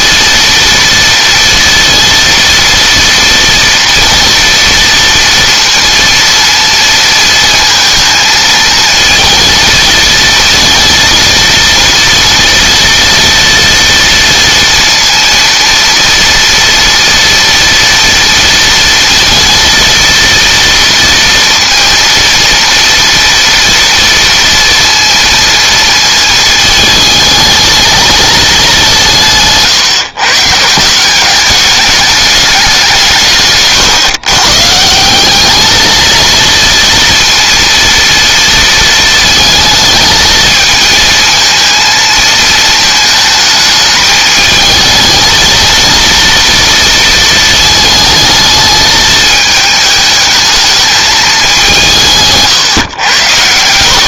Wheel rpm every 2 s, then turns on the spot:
230, 230, 230, 230, 220, 230, 230, 230, 230, 230, 230, 230, 230, 220, 170, 180, 180, 160, 230, 230, 220, 220, 220, 230, 220, 220, 110.
none